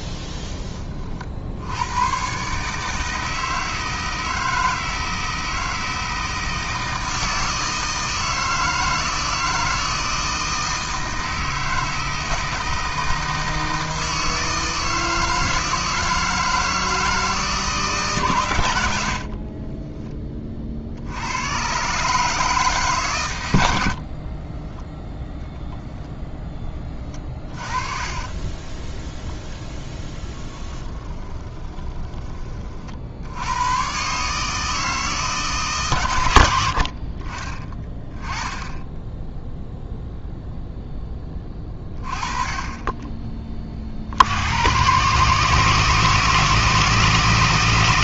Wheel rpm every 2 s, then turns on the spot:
30, 150, 160, 160, 160, 160, 160, 160, 160, 80, 60, 150, 10, 20, 10, 10, 50, 160, 70, 10, 0, 20, 120, 160.
26-28 30-32